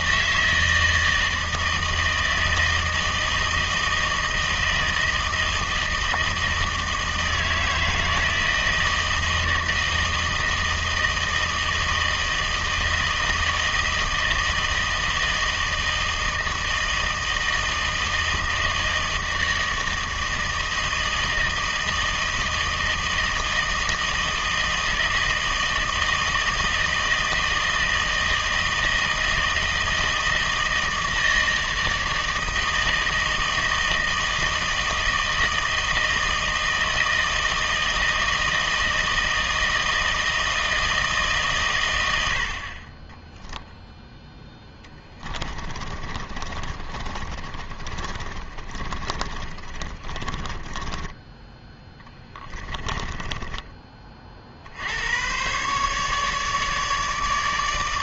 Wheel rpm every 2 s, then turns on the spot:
160, 160, 160, 160, 160, 160, 160, 160, 160, 160, 160, 160, 160, 160, 160, 160, 160, 160, 160, 160, 160, 30, 10, 20, 30, 20, 20, 80, 150.
44-54